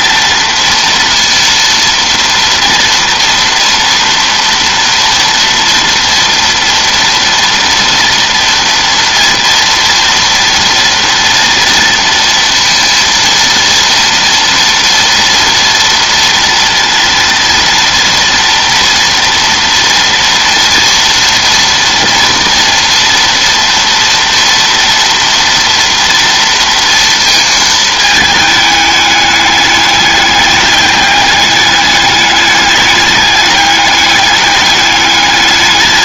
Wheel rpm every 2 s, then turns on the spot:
230, 230, 240, 230, 230, 230, 230, 230, 230, 230, 240, 230, 230, 230, 210, 210, 210, 210.
none